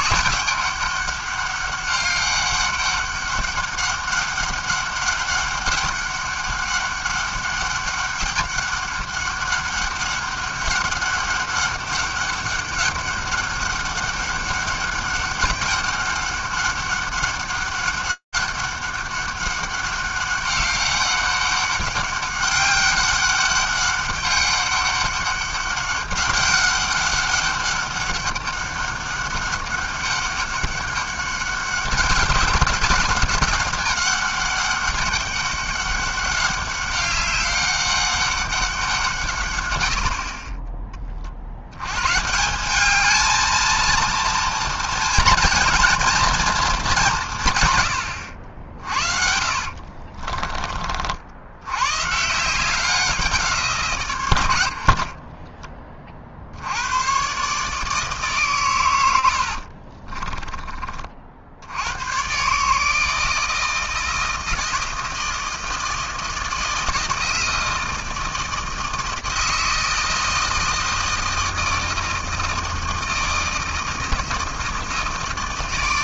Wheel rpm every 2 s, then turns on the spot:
200, 200, 200, 200, 200, 200, 200, 200, 200, 200, 200, 200, 200, 200, 200, 200, 200, 200, 200, 200, 40, 160, 230, 230, 80, 30, 150, 90, 60, 140, 20, 130, 160, 160, 160, 160, 160, 160.
50-52 60-62